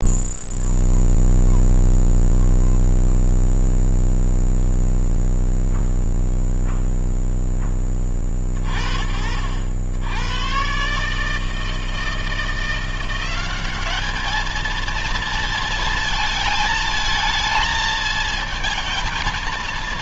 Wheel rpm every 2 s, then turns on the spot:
0, 0, 0, 0, 40, 110, 170, 220, 220, 220.
none